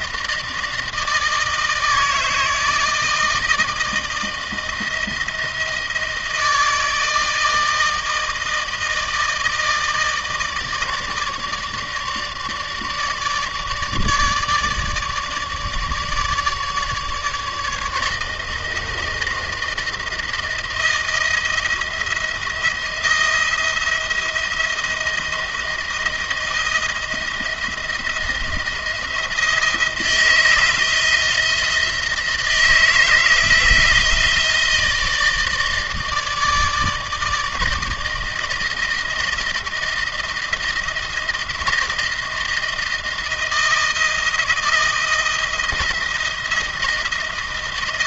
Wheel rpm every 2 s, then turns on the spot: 160, 160, 170, 160, 160, 150, 150, 150, 150, 160, 170, 170, 170, 160, 170, 160, 160, 160, 160, 160, 160, 170, 170, 160.
none